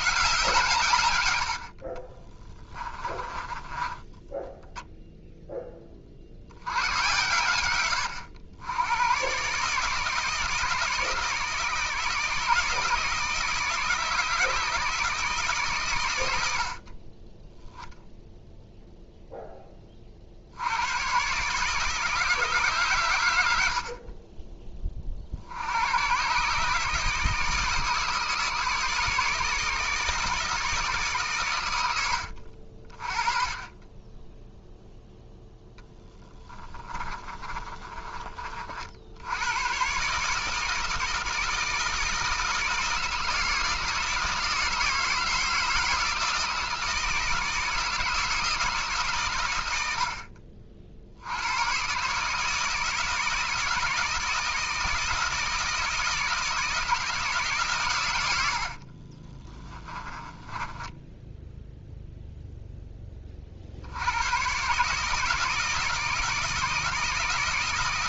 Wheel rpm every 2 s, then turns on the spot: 140, 20, 0, 90, 100, 160, 160, 160, 60, 0, 90, 140, 20, 150, 160, 150, 50, 0, 30, 60, 160, 160, 160, 160, 150, 50, 160, 160, 160, 50, 10, 10, 140, 160.
2-4 36-38 58-62